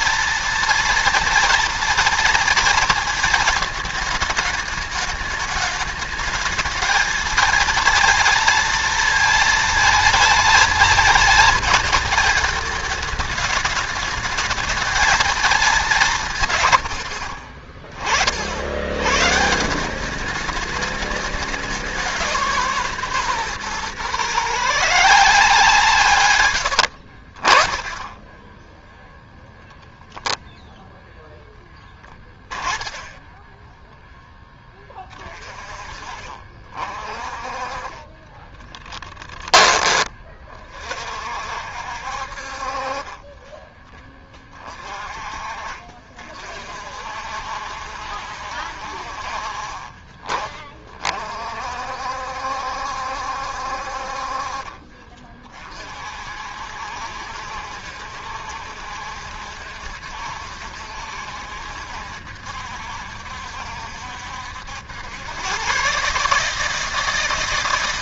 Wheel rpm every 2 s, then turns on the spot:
230, 230, 210, 220, 230, 220, 210, 220, 110, 80, 200, 160, 150, 90, 10, 0, 10, 20, 40, 20, 40, 40, 20, 50, 60, 30, 70, 40, 60, 70, 70, 70, 80, 150.
26-28 38-40 54-56